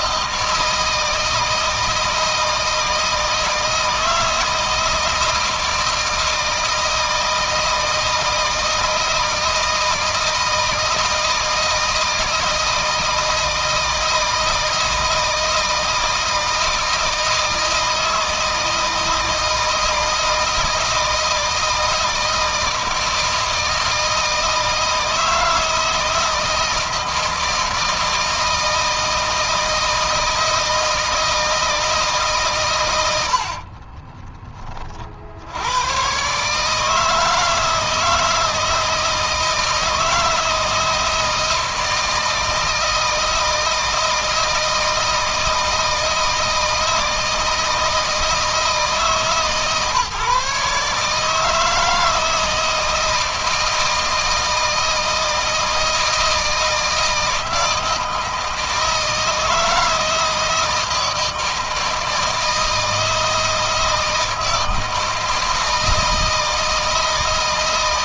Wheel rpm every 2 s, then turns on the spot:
160, 160, 160, 160, 160, 160, 160, 160, 160, 160, 160, 160, 160, 160, 160, 160, 140, 30, 130, 160, 160, 160, 160, 160, 160, 150, 160, 160, 160, 160, 160, 160, 160, 160.
none